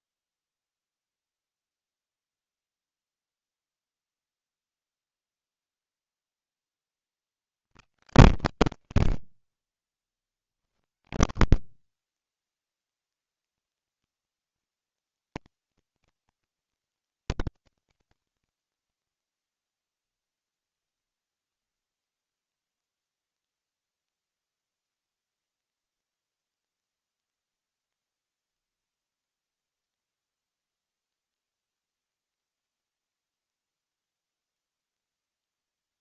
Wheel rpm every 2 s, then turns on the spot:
0, 0, 0, 10, 90, 70, 20, 130, 160, 70, 0, 0, 0, 0, 0, 0, 0, 0.
none